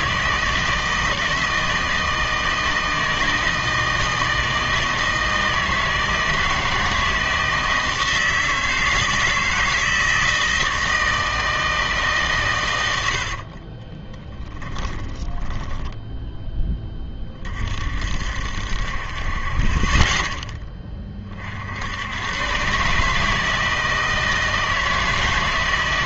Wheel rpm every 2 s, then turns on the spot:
160, 160, 160, 160, 160, 160, 110, 20, 10, 60, 10, 130, 160.
14-16